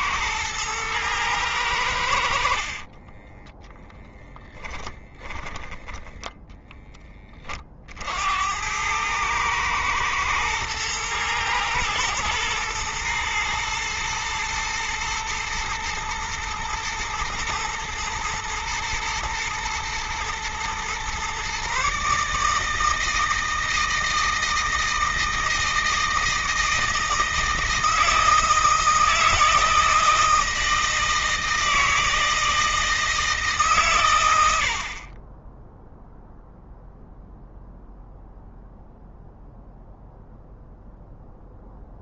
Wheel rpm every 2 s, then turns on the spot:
110, 30, 10, 20, 100, 110, 110, 110, 110, 110, 120, 160, 160, 160, 160, 160, 160, 50, 0, 0, 0.
2-4